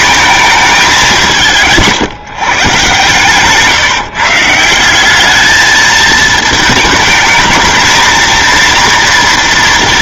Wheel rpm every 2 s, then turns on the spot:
220, 150, 170, 220, 230.
none